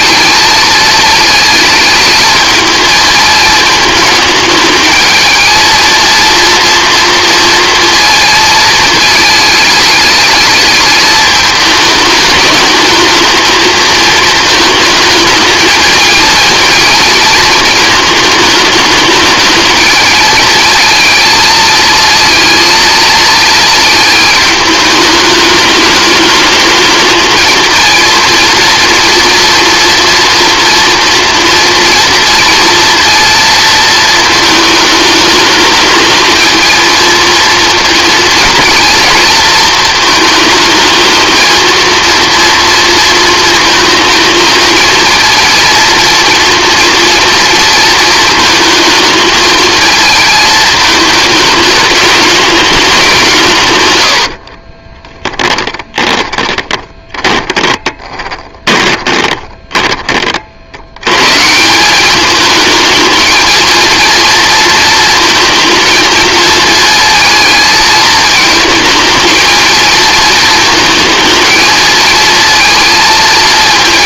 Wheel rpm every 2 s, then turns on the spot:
220, 220, 220, 230, 220, 210, 220, 220, 230, 220, 230, 230, 210, 220, 230, 230, 230, 220, 220, 230, 220, 230, 230, 240, 220, 220, 210, 30, 20, 20, 90, 220, 230, 220, 220, 230, 220.
54-60